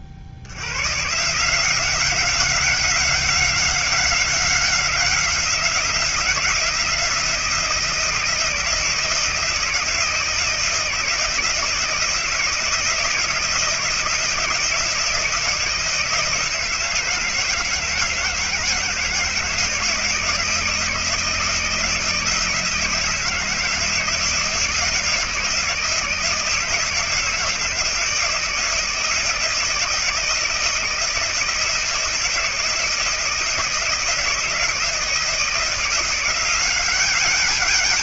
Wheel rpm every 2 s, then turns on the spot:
80, 190, 190, 170, 170, 160, 170, 160, 160, 160, 160, 160, 160, 170, 170, 160, 160, 170, 200.
none